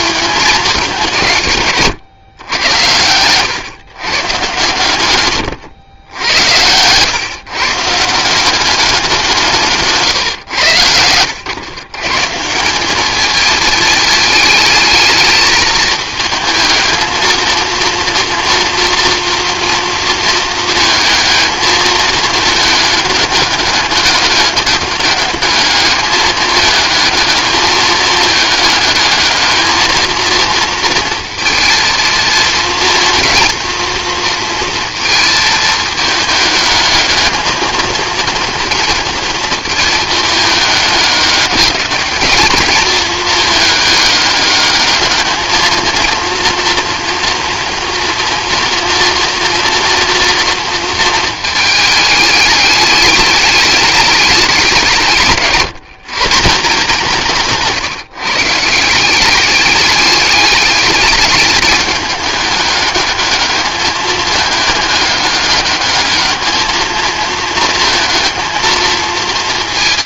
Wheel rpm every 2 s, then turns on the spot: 200, 100, 120, 110, 190, 110, 170, 210, 220, 230, 220, 210, 210, 220, 210, 230, 230, 230, 210, 230, 210, 210, 210, 230, 240, 230, 210, 190, 170, 150, 210, 210, 210, 220, 230.
none